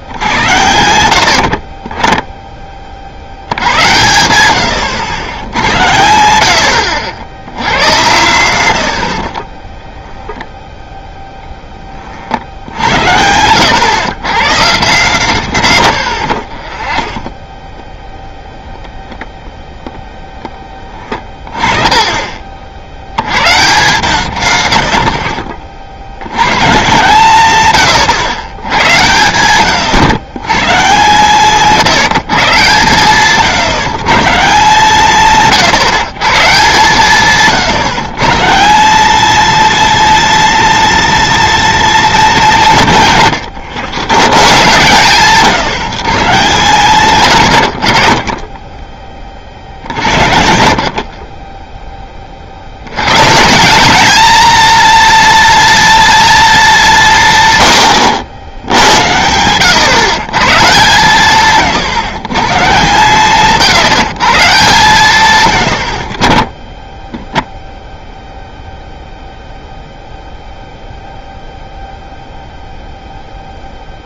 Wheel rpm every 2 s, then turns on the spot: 90, 20, 100, 100, 100, 10, 80, 150, 40, 0, 20, 30, 120, 130, 100, 130, 140, 160, 150, 150, 230, 180, 120, 130, 20, 70, 50, 230, 220, 80, 140, 140, 140, 30, 0, 0, 0.
16-18